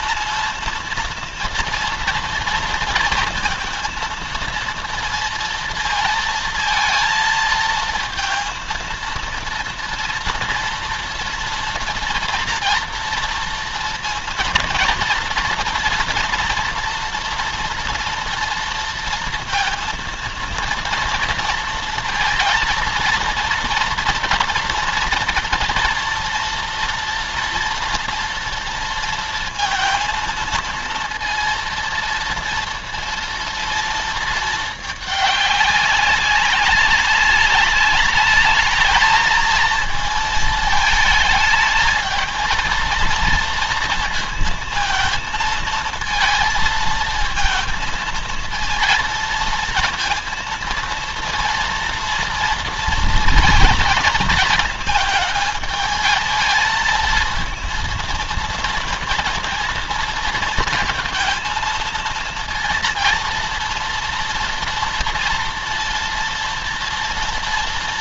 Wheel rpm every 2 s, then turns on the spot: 230, 230, 230, 230, 230, 230, 230, 230, 240, 230, 230, 230, 230, 230, 230, 230, 230, 220, 200, 220, 220, 230, 220, 230, 230, 230, 230, 220, 220, 230, 220, 230, 230, 230.
none